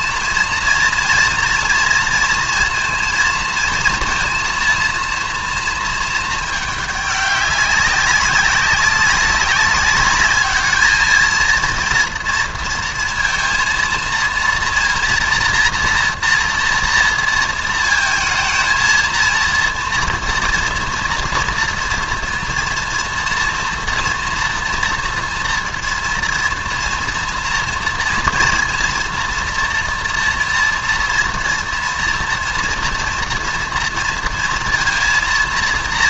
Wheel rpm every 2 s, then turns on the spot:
230, 230, 230, 210, 200, 210, 230, 230, 230, 220, 230, 230, 230, 230, 230, 230, 230, 230.
none